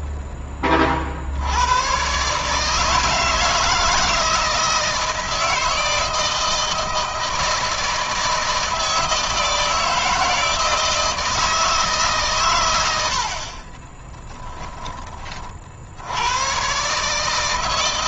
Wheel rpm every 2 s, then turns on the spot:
40, 160, 160, 160, 160, 160, 80, 20, 140.
none